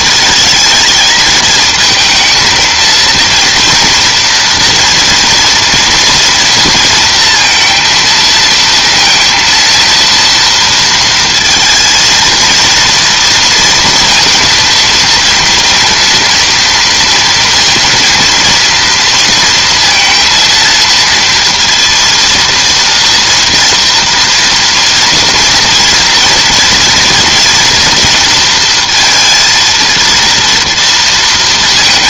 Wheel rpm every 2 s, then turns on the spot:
220, 230, 230, 230, 230, 230, 230, 230, 230, 230, 230, 230, 230, 240, 230, 230.
none